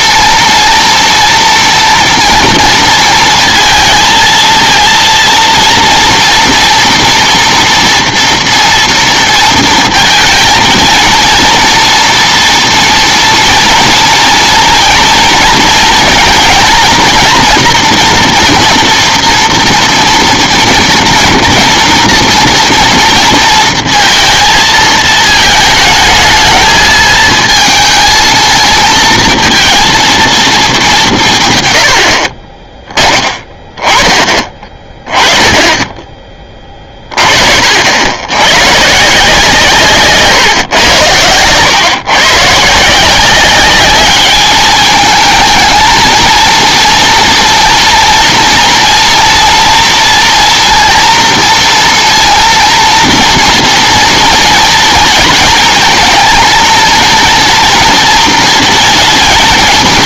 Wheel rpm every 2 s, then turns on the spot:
230, 230, 230, 230, 230, 230, 240, 230, 230, 230, 230, 230, 230, 220, 220, 210, 20, 20, 20, 120, 130, 150, 210, 230, 240, 230, 230, 230, 230, 230.
none